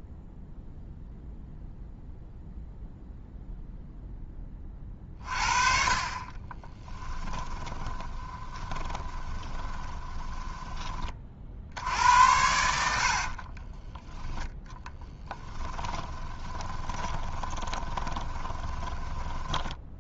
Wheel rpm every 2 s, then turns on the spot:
0, 0, 30, 20, 20, 30, 70, 10, 20, 10.
6-10 14-20